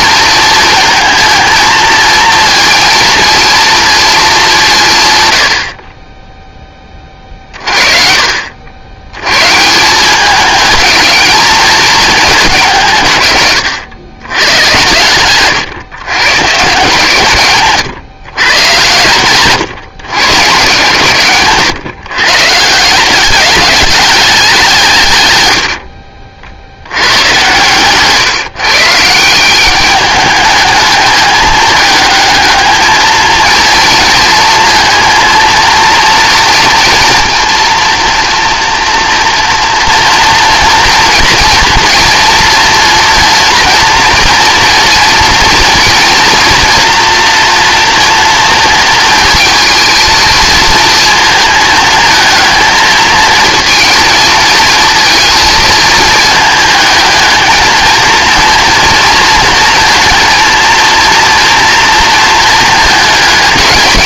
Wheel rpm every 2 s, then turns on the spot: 230, 230, 180, 10, 70, 210, 180, 120, 130, 130, 130, 150, 180, 80, 150, 210, 210, 230, 230, 230, 230, 230, 230, 230, 230, 220, 220, 230, 220, 230, 230, 220.
none